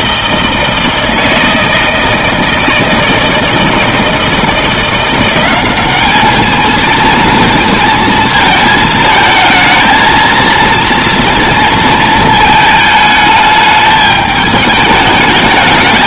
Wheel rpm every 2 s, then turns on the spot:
160, 160, 170, 220, 220, 230, 220, 210.
none